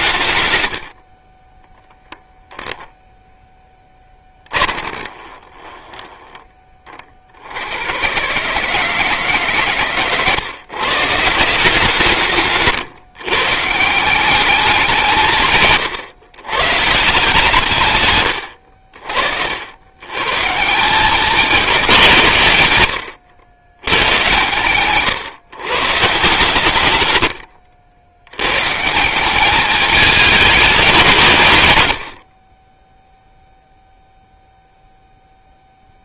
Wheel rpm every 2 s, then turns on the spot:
80, 0, 20, 30, 160, 140, 140, 190, 150, 70, 180, 100, 130, 110, 150, 200, 0, 0.
4-6